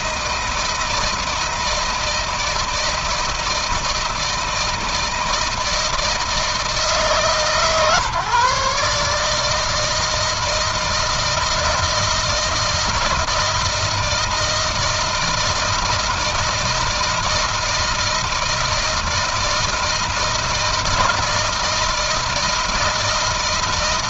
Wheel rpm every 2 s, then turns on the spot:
160, 160, 160, 150, 150, 160, 170, 160, 160, 160, 160, 160.
none